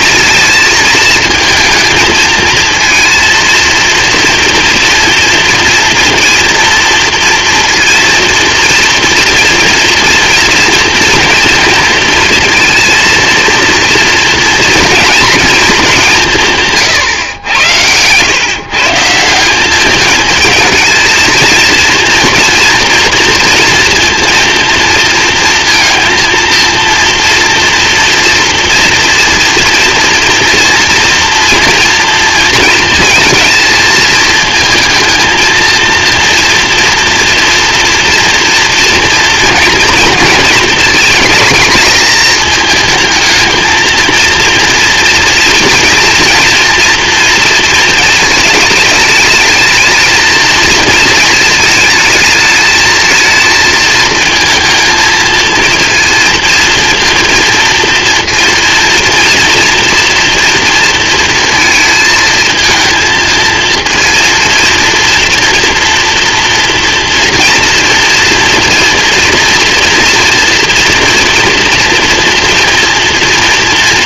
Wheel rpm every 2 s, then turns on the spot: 220, 230, 230, 230, 230, 240, 230, 230, 160, 140, 220, 240, 230, 230, 230, 230, 230, 220, 230, 230, 220, 220, 230, 230, 220, 230, 220, 220, 230, 230, 230, 230, 230, 230, 240, 230, 230.
none